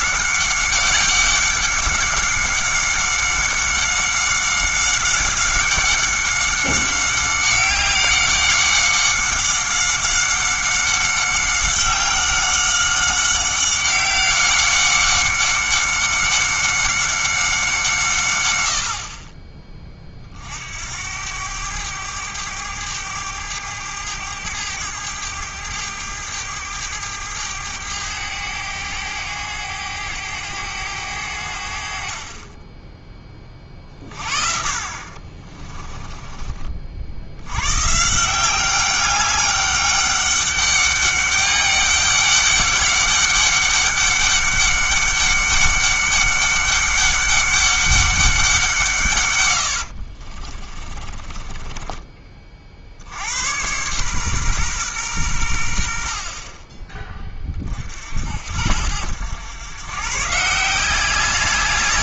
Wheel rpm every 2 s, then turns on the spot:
190, 200, 190, 190, 190, 190, 190, 190, 190, 70, 70, 100, 100, 100, 100, 100, 10, 50, 60, 190, 200, 200, 200, 200, 150, 30, 60, 120, 20, 80, 170.
50-52